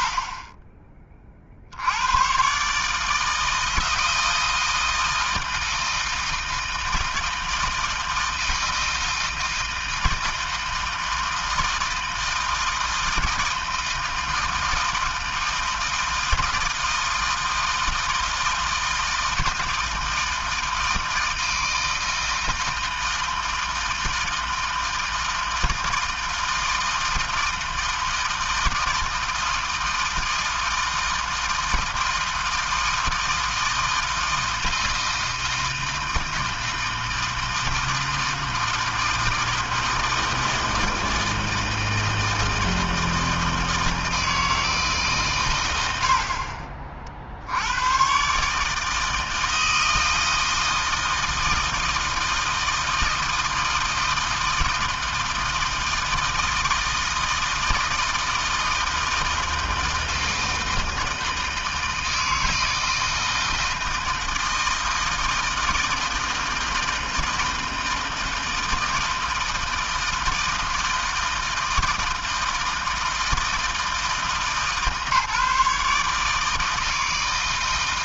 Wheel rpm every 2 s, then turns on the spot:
30, 150, 160, 160, 160, 160, 160, 160, 160, 160, 160, 160, 160, 160, 160, 170, 160, 160, 160, 160, 160, 160, 150, 50, 160, 160, 160, 160, 160, 160, 160, 160, 160, 160, 160, 160, 160, 150, 160.
none